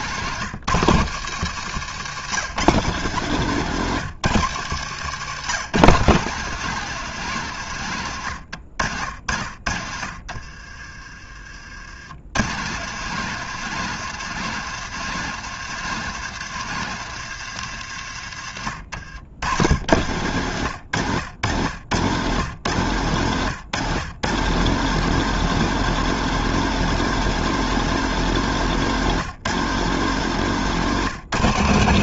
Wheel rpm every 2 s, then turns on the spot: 150, 150, 140, 160, 60, 40, 160, 160, 130, 80, 100, 120, 180, 190, 170, 170.
none